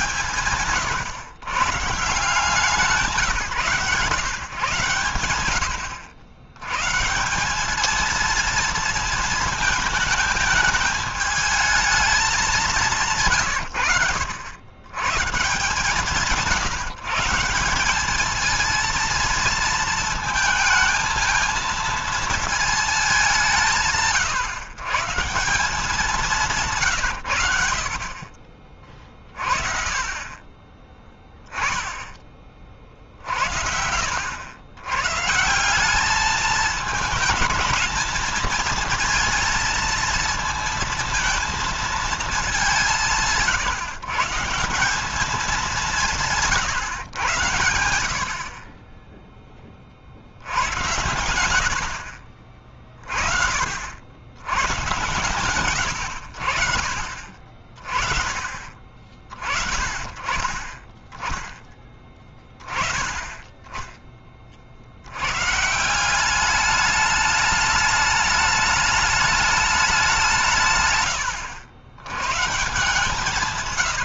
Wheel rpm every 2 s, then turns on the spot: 130, 170, 120, 110, 230, 210, 190, 100, 170, 220, 220, 230, 150, 170, 30, 20, 30, 90, 220, 220, 220, 210, 160, 150, 40, 80, 30, 100, 60, 30, 40, 20, 50, 200, 210, 160, 130.
none